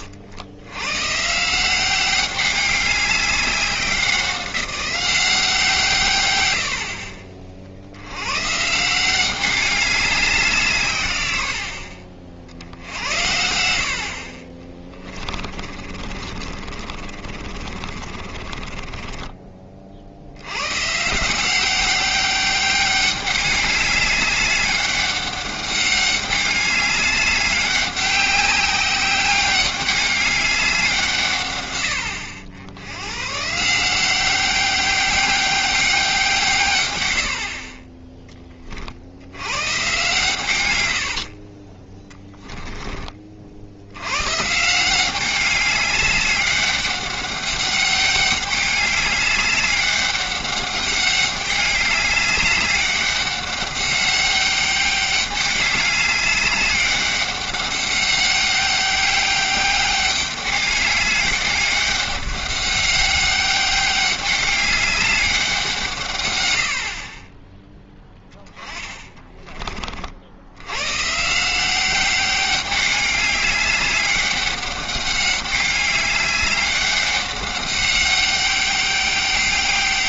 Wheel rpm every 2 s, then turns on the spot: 100, 200, 180, 70, 150, 160, 70, 30, 40, 20, 120, 200, 200, 200, 190, 190, 90, 190, 120, 40, 100, 10, 160, 200, 200, 190, 200, 200, 200, 200, 200, 200, 200, 80, 20, 110, 200, 200, 200, 200.
14-20 40-42 68-70